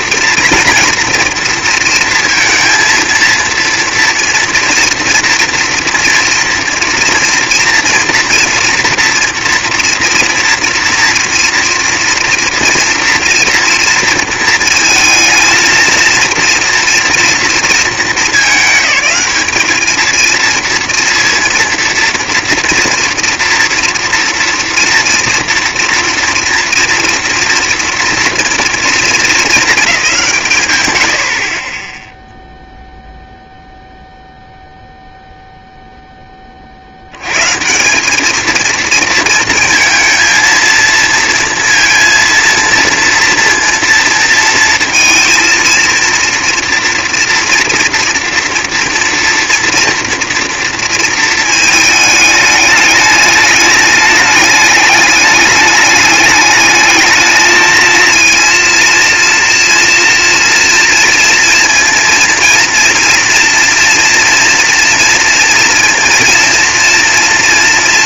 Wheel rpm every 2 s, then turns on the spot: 230, 230, 230, 230, 230, 230, 240, 230, 230, 190, 230, 230, 230, 230, 230, 130, 0, 0, 140, 230, 230, 230, 230, 230, 230, 220, 210, 210, 220, 230, 230, 230, 230, 230.
none